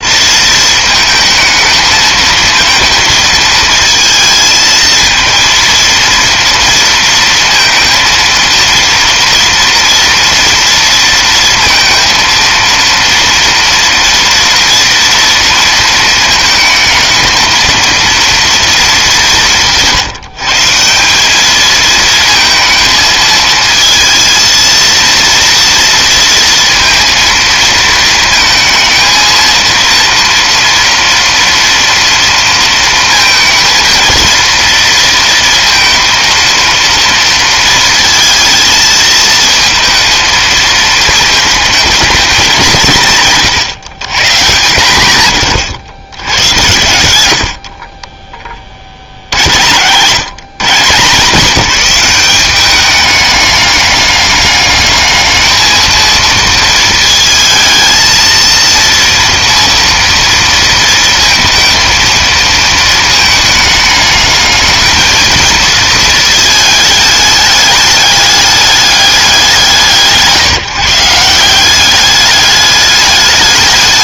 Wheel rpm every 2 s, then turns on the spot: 220, 230, 220, 230, 230, 230, 230, 240, 220, 230, 170, 220, 230, 230, 220, 230, 230, 230, 230, 230, 220, 190, 130, 90, 40, 160, 200, 210, 220, 230, 230, 230, 220, 220, 210, 150, 210.
none